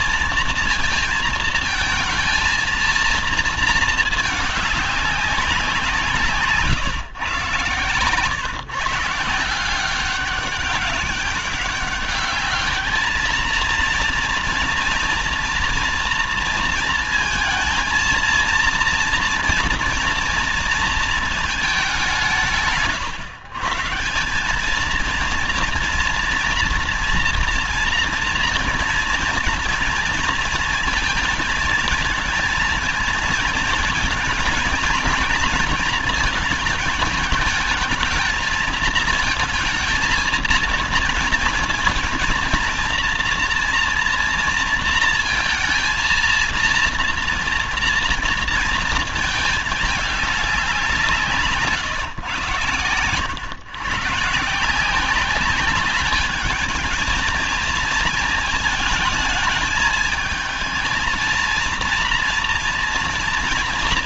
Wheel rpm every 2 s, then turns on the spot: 230, 230, 210, 140, 140, 190, 210, 240, 230, 230, 230, 170, 190, 240, 230, 230, 220, 220, 230, 220, 220, 230, 230, 230, 230, 200, 120, 160, 210, 220, 220, 230.
none